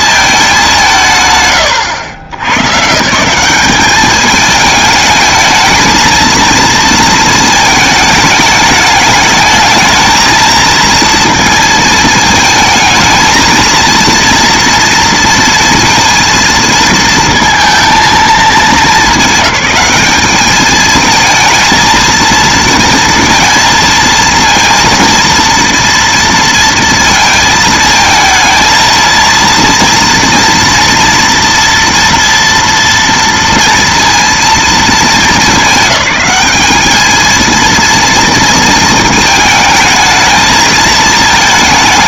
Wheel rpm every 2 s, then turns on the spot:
190, 130, 210, 230, 210, 230, 220, 230, 230, 220, 220, 230, 230, 230, 230, 230, 230, 220, 210, 230, 220.
none